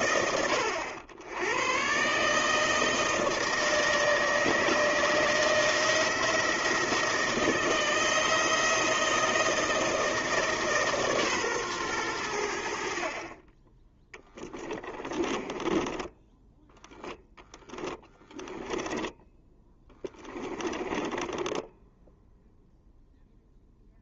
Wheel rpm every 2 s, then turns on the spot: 100, 160, 160, 160, 160, 140, 40, 20, 10, 10, 10, 0.
14-22